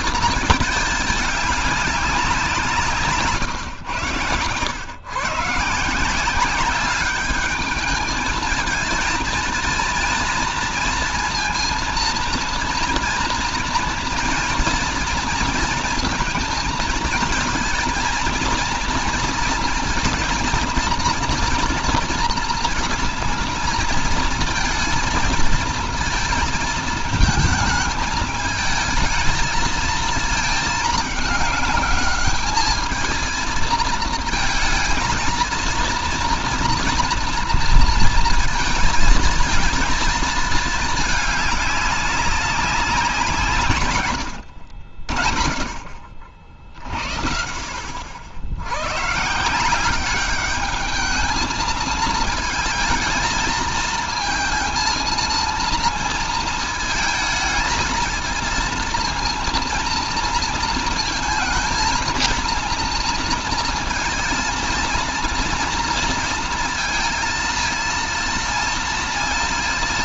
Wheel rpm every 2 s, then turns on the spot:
220, 190, 120, 190, 220, 230, 230, 230, 220, 230, 230, 240, 230, 220, 220, 220, 210, 220, 230, 230, 220, 200, 70, 60, 90, 200, 220, 230, 220, 220, 230, 230, 230, 230, 230.
none